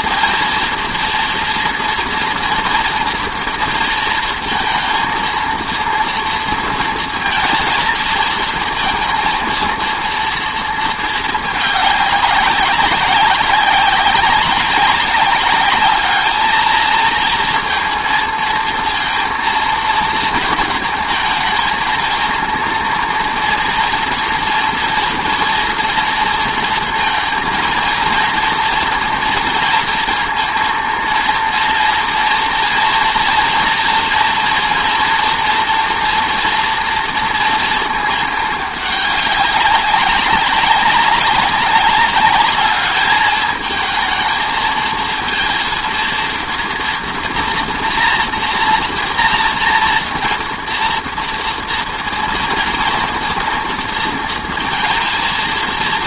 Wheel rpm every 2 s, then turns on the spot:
230, 240, 230, 230, 230, 230, 190, 190, 220, 230, 230, 230, 230, 230, 230, 230, 230, 230, 230, 210, 200, 210, 220, 230, 230, 230, 230, 230.
none